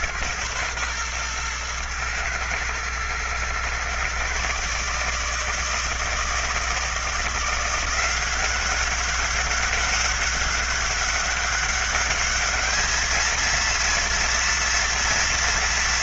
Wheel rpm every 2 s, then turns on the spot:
120, 110, 140, 160, 190, 200, 210, 230.
none